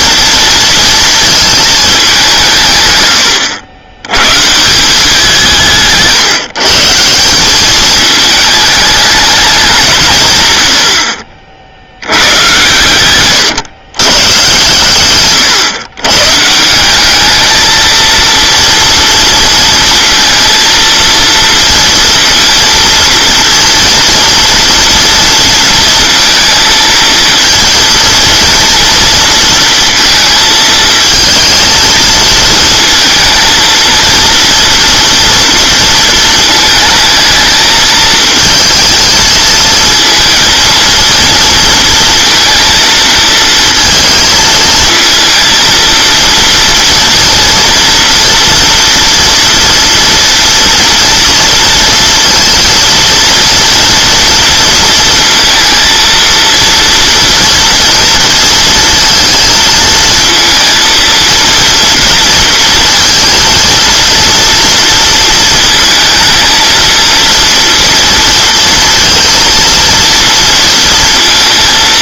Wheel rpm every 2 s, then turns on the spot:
230, 150, 170, 150, 210, 100, 110, 120, 160, 230, 230, 230, 230, 230, 230, 230, 230, 230, 230, 220, 230, 230, 220, 230, 240, 230, 230, 230, 230, 230, 230, 230, 230, 230, 230, 230.
none